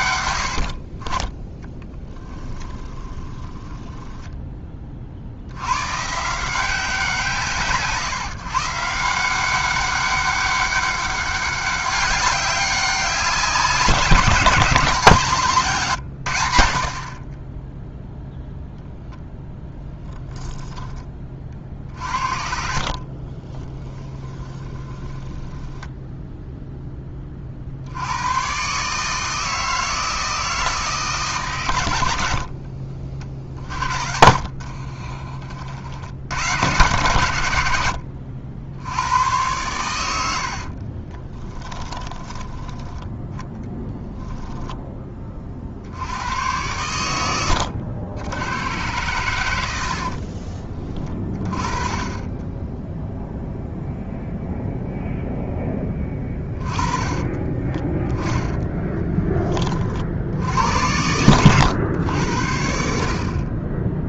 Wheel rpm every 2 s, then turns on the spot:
50, 10, 30, 170, 150, 200, 200, 180, 60, 0, 10, 40, 10, 10, 140, 160, 50, 40, 110, 80, 30, 10, 10, 100, 100, 20, 10, 0, 20, 10, 90, 60.
2-4 22-26 32-36 40-42 56-60